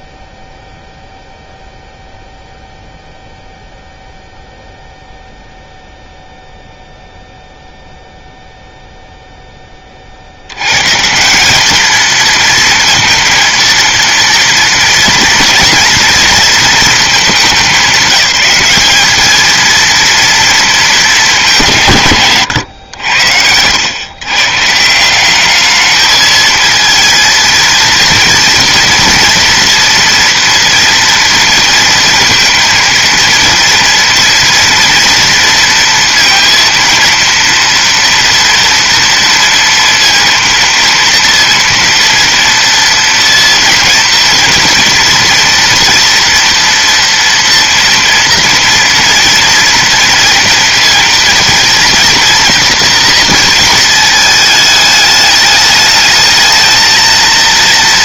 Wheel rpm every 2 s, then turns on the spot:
0, 0, 0, 0, 0, 120, 230, 230, 230, 210, 220, 110, 170, 220, 230, 230, 230, 230, 230, 230, 230, 230, 230, 230, 230, 230, 230, 210, 220.
none